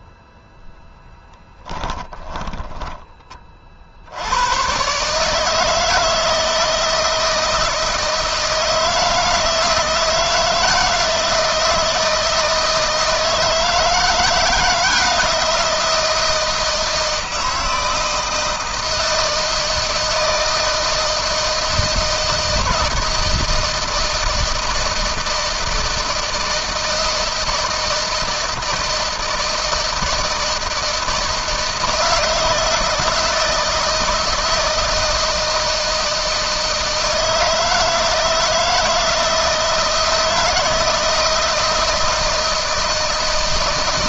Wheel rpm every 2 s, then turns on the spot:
10, 30, 140, 160, 160, 170, 160, 170, 160, 160, 160, 160, 160, 160, 160, 160, 160, 160, 160, 160, 160, 160.
0-2